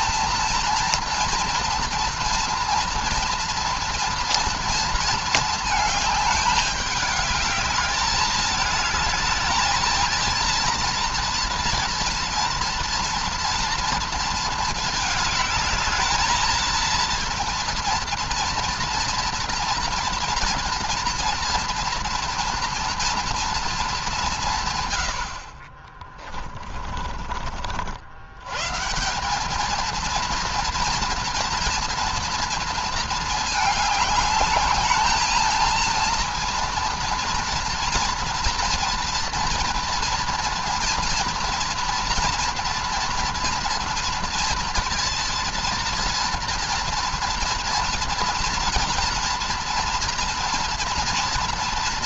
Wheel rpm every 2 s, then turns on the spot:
230, 230, 230, 210, 210, 230, 240, 220, 230, 240, 240, 230, 140, 30, 130, 230, 230, 220, 230, 230, 240, 230, 230, 230, 230, 230.
26-28